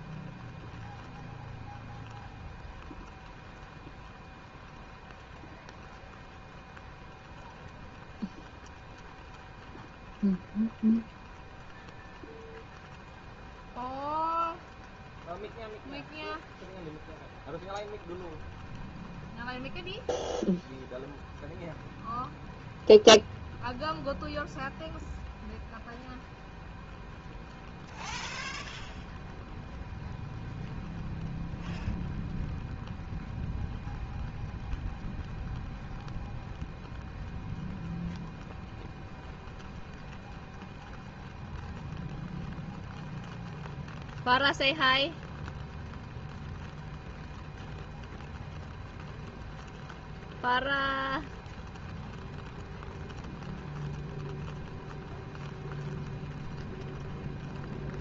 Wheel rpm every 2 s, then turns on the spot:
0, 0, 0, 0, 0, 0, 0, 0, 0, 0, 0, 0, 0, 0, 0, 0, 0, 0, 0, 0, 0, 0, 0, 0, 0, 0, 0, 0, 0.
none